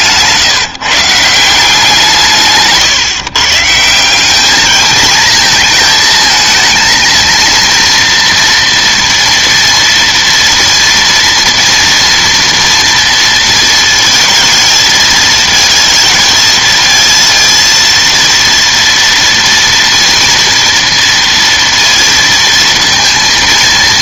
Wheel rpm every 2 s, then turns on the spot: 150, 150, 210, 230, 230, 230, 230, 220, 220, 230, 230, 230.
none